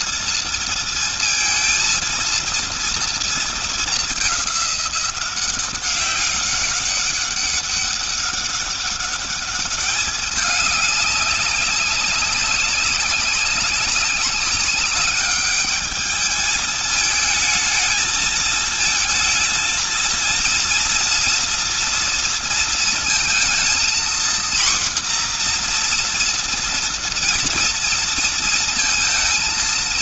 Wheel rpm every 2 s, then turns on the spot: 230, 230, 190, 190, 200, 200, 200, 200, 220, 220, 230, 230, 250, 240, 230.
none